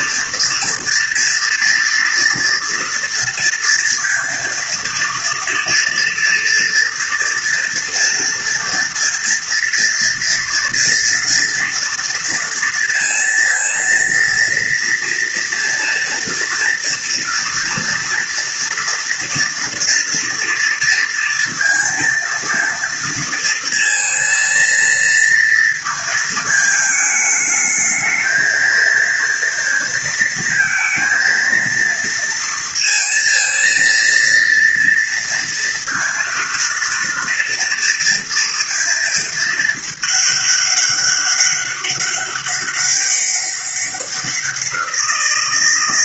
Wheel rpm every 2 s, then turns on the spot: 230, 230, 230, 230, 230, 230, 230, 230, 230, 230, 230, 230, 230, 220, 230, 230, 230, 230, 230, 230, 200, 200, 180.
none